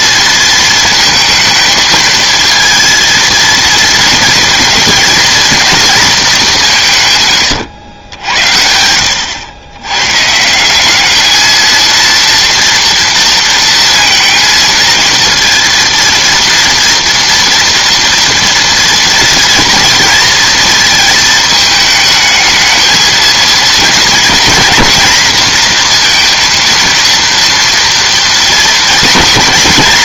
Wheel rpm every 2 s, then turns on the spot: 230, 230, 230, 190, 80, 180, 230, 230, 240, 230, 230, 220, 240, 230, 230.
none